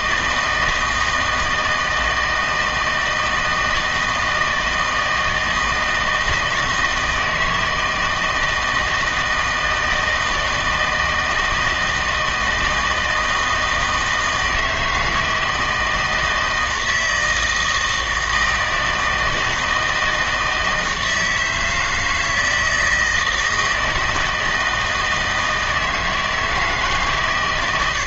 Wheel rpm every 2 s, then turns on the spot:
160, 160, 160, 160, 160, 160, 160, 160, 160, 160, 160, 160, 160, 150.
none